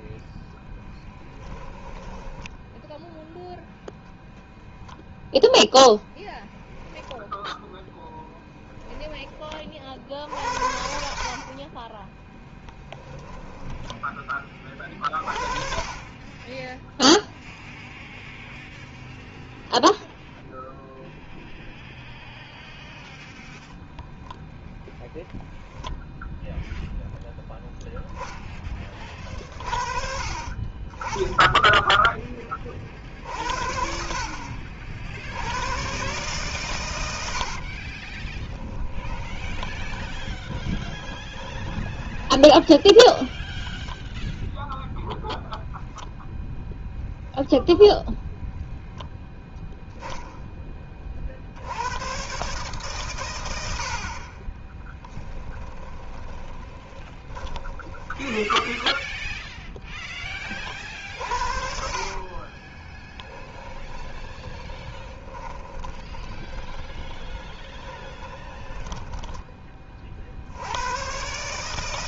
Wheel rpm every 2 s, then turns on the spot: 10, 10, 0, 10, 10, 60, 10, 20, 10, 0, 0, 0, 10, 0, 20, 30, 40, 60, 110, 20, 20, 10, 0, 20, 10, 20, 130, 30, 20, 0, 40, 40, 20, 20, 20, 80.
0-4 12-14 38-42 46-48 54-58 62-70